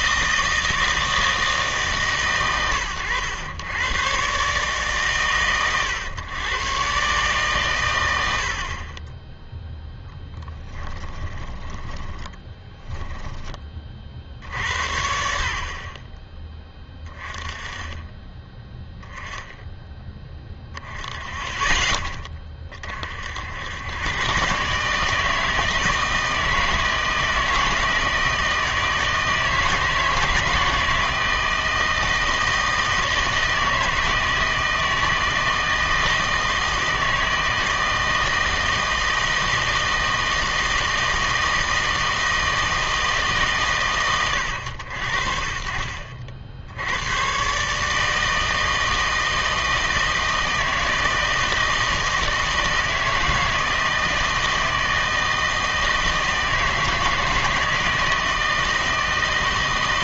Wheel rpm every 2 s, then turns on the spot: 160, 110, 140, 130, 40, 10, 10, 70, 20, 10, 10, 30, 140, 160, 160, 160, 160, 160, 160, 160, 170, 160, 90, 80, 160, 160, 160, 160, 160, 160.
10-14